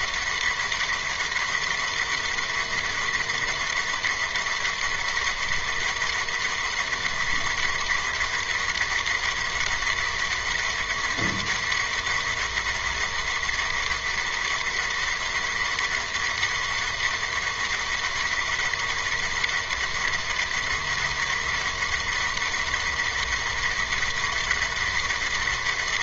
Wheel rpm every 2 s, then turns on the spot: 200, 200, 200, 200, 200, 200, 200, 200, 200, 200, 200, 200, 200.
none